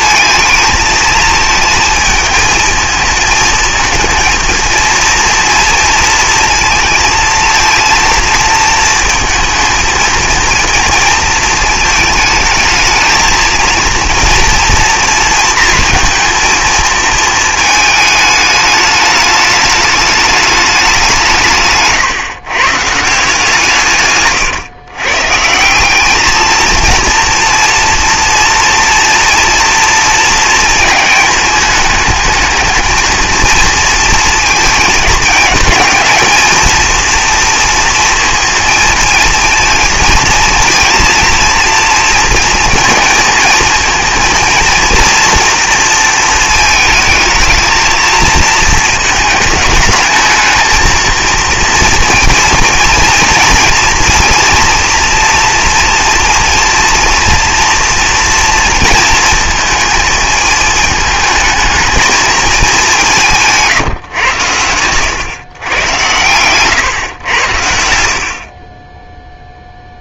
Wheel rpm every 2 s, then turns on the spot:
220, 220, 230, 230, 230, 230, 220, 230, 230, 210, 200, 130, 130, 220, 230, 220, 220, 220, 220, 230, 220, 230, 230, 220, 220, 220, 230, 240, 230, 230, 220, 210, 100, 120, 40.
none